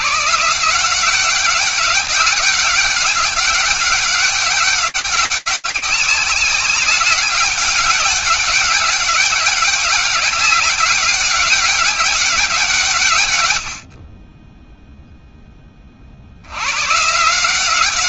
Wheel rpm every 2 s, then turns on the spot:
160, 190, 190, 190, 200, 200, 180, 20, 130.
none